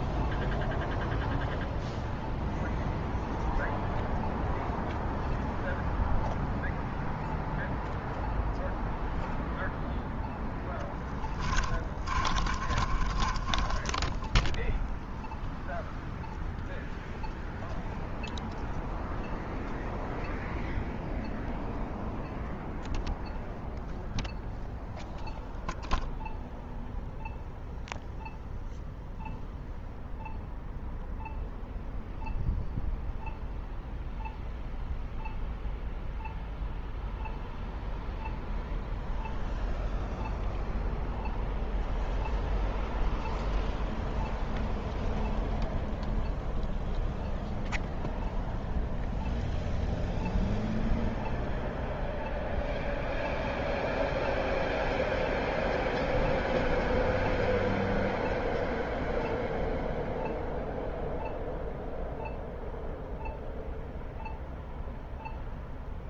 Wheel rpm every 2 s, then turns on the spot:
0, 0, 0, 0, 0, 10, 30, 0, 0, 0, 0, 0, 0, 0, 0, 0, 0, 0, 0, 0, 0, 0, 0, 0, 0, 0, 0, 0, 0, 0, 0, 0, 0.
10-14